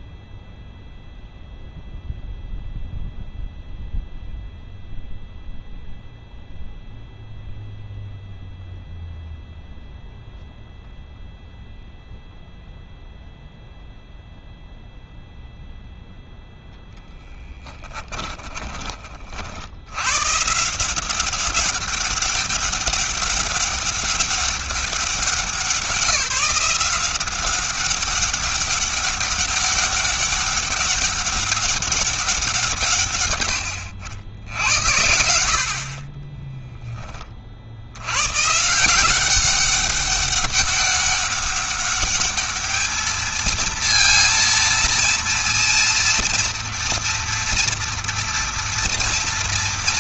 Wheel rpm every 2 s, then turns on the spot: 0, 0, 0, 0, 0, 0, 0, 0, 0, 20, 150, 200, 200, 180, 200, 200, 170, 90, 20, 150, 200, 210, 230, 240, 230.
none